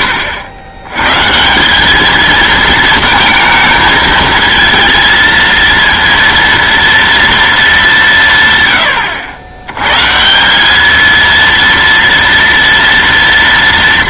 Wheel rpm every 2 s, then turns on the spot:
130, 230, 230, 230, 100, 220, 230.
none